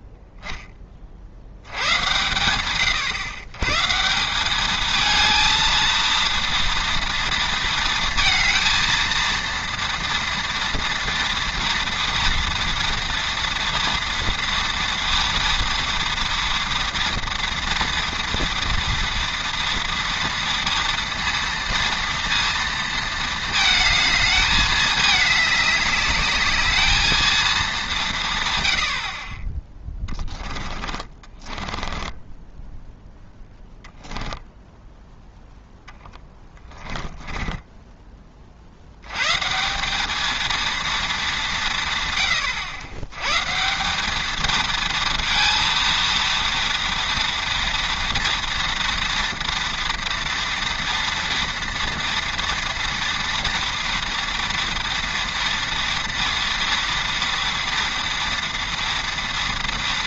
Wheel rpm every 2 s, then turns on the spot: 10, 120, 210, 230, 230, 230, 230, 230, 230, 230, 230, 230, 210, 220, 100, 20, 10, 0, 20, 60, 230, 100, 230, 230, 230, 230, 230, 230, 230, 230.
30-34 36-38